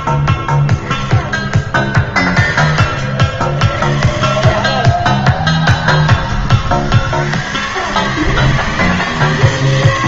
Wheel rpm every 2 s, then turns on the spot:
10, 40, 50, 50, 160.
4-6